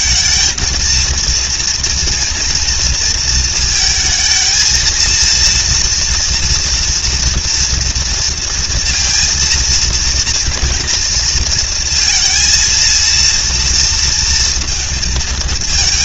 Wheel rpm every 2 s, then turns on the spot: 230, 230, 230, 230, 230, 240, 230, 220.
none